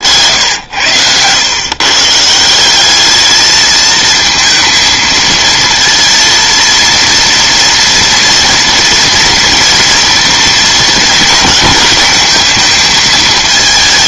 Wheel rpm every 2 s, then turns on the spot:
90, 190, 220, 230, 230, 230, 220.
none